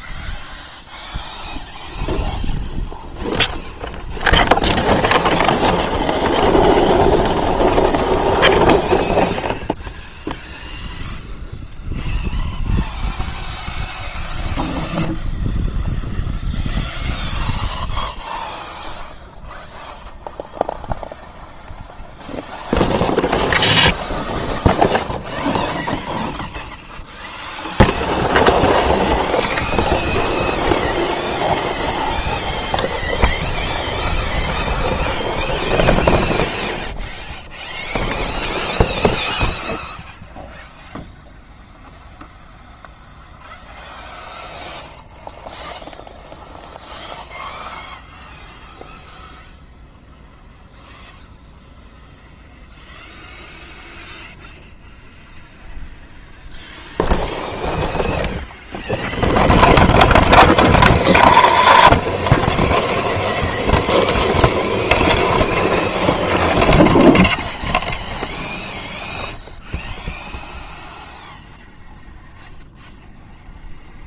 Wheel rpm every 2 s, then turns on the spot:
0, 0, 0, 0, 0, 0, 0, 0, 0, 0, 0, 0, 0, 0, 0, 0, 0, 0, 0, 0, 0, 0, 0, 0, 0, 0, 0, 0, 0, 0, 0, 0, 0, 0, 0, 0, 0.
none